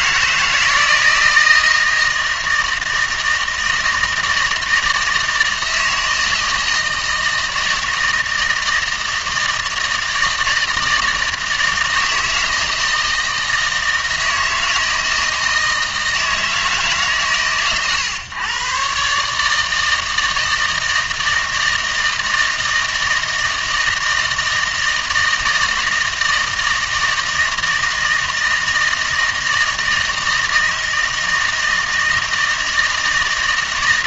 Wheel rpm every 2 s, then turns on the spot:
160, 160, 160, 160, 160, 160, 160, 160, 150, 130, 160, 160, 160, 160, 160, 160, 160.
none